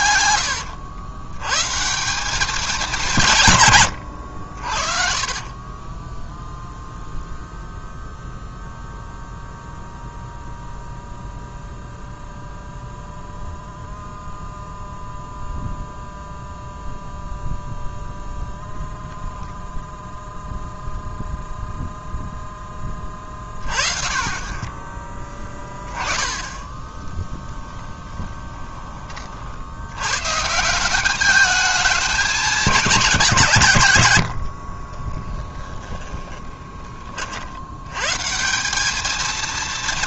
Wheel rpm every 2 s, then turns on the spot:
90, 190, 60, 0, 0, 0, 0, 0, 0, 0, 0, 10, 10, 10, 10, 160, 210, 40, 20, 200.
4-6 34-36